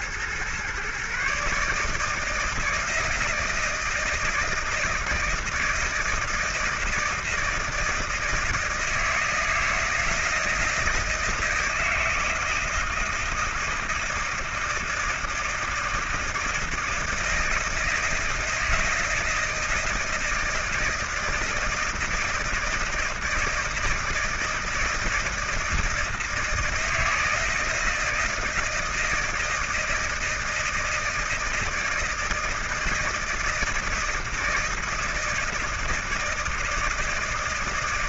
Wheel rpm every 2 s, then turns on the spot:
120, 160, 160, 160, 160, 160, 160, 160, 160, 170, 160, 160, 160, 160, 160, 160, 160, 160, 160.
none